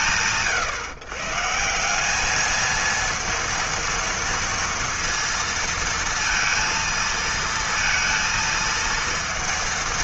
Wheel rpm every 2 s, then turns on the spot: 140, 230, 230, 230, 230.
none